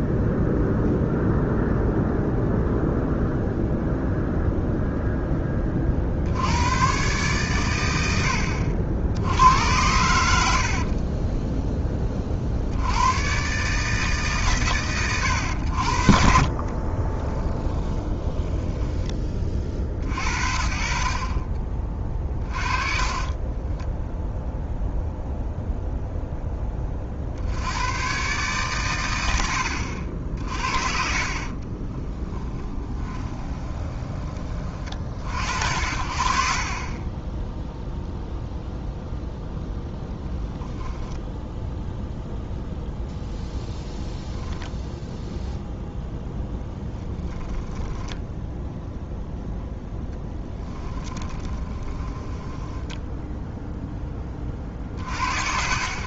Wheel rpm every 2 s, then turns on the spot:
0, 0, 0, 100, 70, 50, 40, 100, 30, 10, 60, 30, 0, 30, 130, 50, 20, 40, 40, 0, 0, 0, 10, 10, 0, 10, 10, 40.
10-12 16-20 22-24 30-34 46-48 50-54